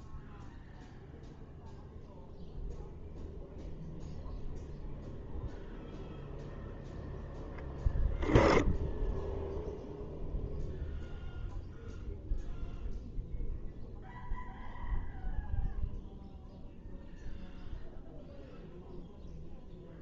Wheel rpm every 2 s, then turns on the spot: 0, 0, 0, 0, 0, 0, 0, 0, 0, 0.
none